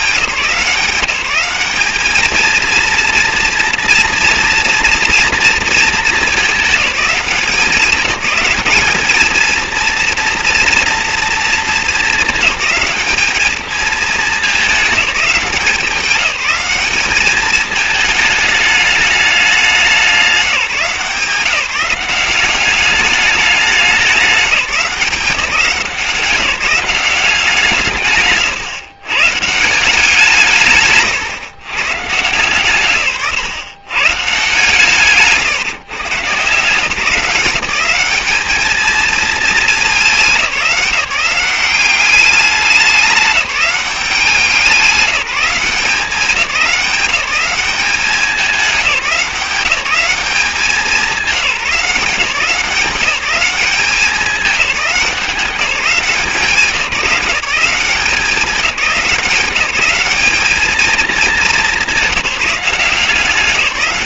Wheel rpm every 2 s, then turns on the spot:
160, 230, 230, 210, 200, 230, 210, 210, 200, 220, 180, 190, 200, 180, 120, 140, 130, 140, 140, 210, 190, 200, 180, 190, 190, 190, 180, 200, 180, 180, 210, 190.
none